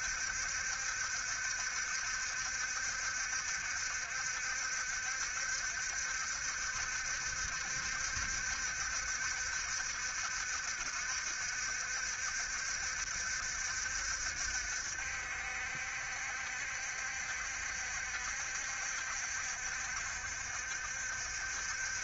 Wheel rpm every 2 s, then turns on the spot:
70, 60, 70, 70, 70, 60, 70, 70, 70, 70, 70.
none